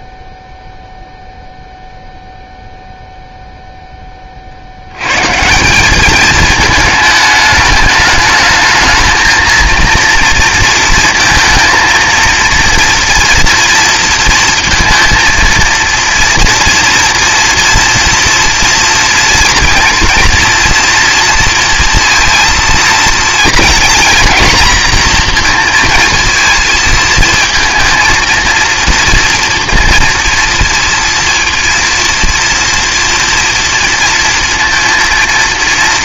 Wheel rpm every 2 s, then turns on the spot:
0, 0, 70, 220, 220, 230, 230, 230, 230, 230, 230, 230, 240, 230, 230, 230, 240, 230.
none